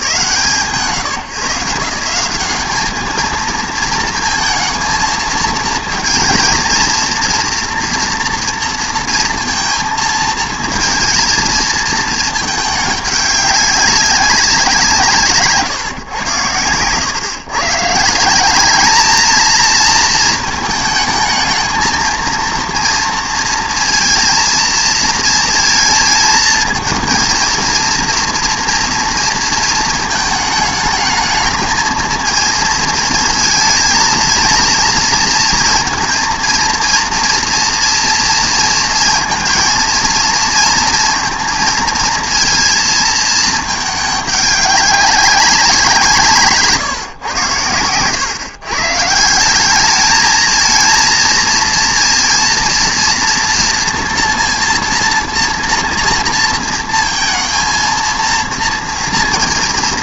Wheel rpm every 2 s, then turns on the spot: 130, 200, 220, 230, 230, 230, 210, 180, 110, 210, 220, 230, 230, 220, 230, 220, 230, 230, 230, 230, 230, 230, 200, 130, 140, 230, 230, 230, 230, 230.
none